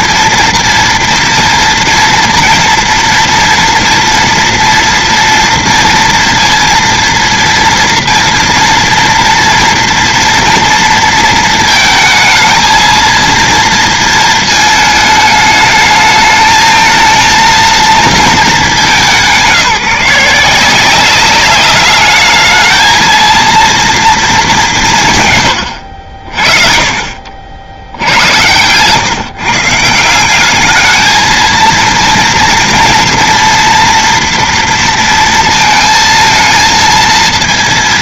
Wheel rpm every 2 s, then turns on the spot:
240, 230, 230, 230, 230, 230, 230, 220, 220, 200, 180, 220, 170, 40, 120, 210, 230, 230, 230.
none